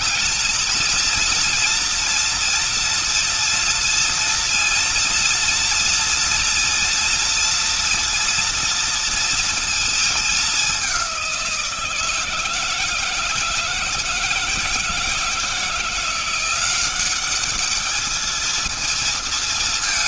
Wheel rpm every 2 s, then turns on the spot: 230, 230, 230, 230, 230, 210, 160, 170, 170, 220.
none